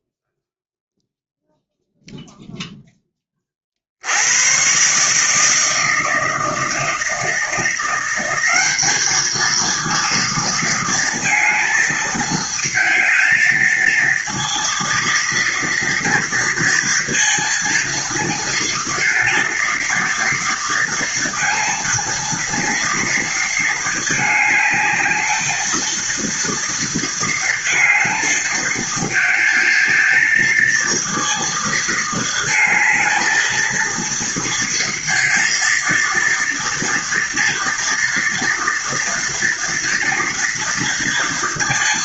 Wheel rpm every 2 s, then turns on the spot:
0, 10, 140, 160, 210, 230, 220, 230, 230, 230, 230, 230, 220, 230, 220, 230, 220, 230, 230, 230, 230.
none